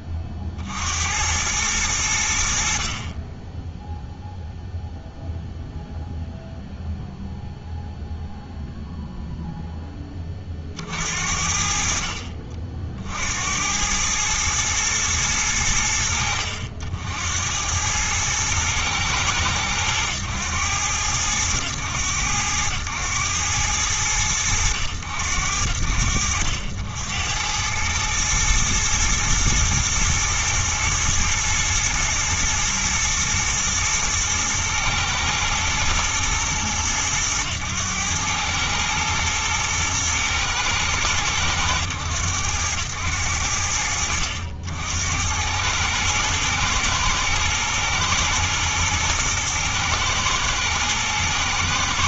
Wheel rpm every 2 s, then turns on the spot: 40, 50, 0, 0, 0, 50, 50, 110, 80, 110, 100, 100, 90, 80, 110, 120, 120, 110, 110, 110, 110, 90, 80, 120, 110, 110.
none